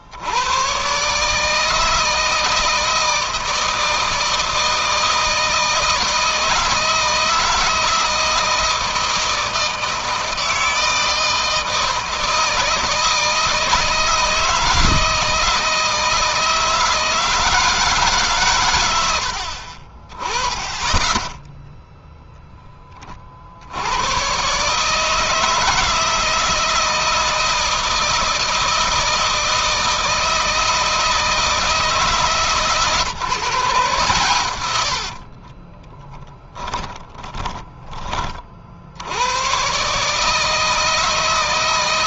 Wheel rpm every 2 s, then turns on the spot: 130, 160, 160, 160, 160, 160, 160, 160, 160, 100, 20, 20, 150, 160, 160, 160, 150, 80, 30, 70, 160.
34-38